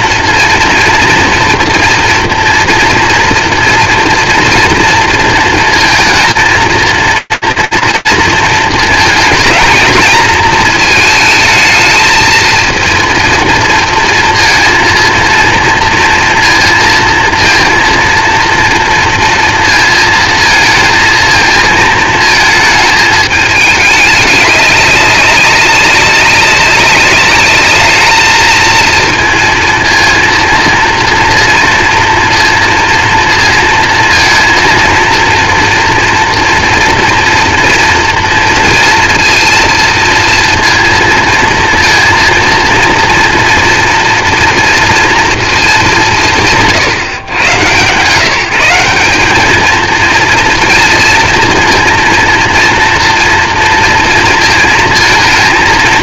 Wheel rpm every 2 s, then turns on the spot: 230, 240, 230, 220, 230, 230, 230, 230, 230, 230, 220, 220, 210, 200, 220, 230, 230, 230, 240, 230, 230, 230, 230, 140, 160, 230, 230, 230.
none